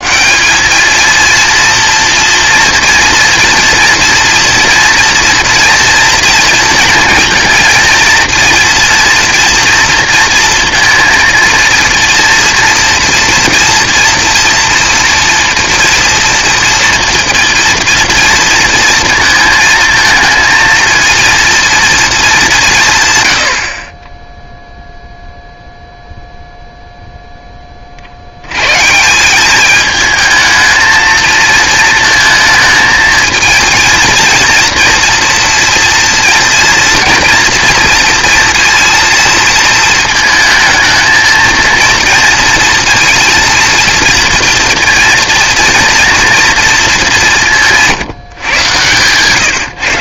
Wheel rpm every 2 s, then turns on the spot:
200, 230, 230, 230, 230, 230, 230, 230, 230, 230, 230, 170, 0, 0, 120, 220, 220, 230, 240, 230, 220, 230, 230, 230, 130.
none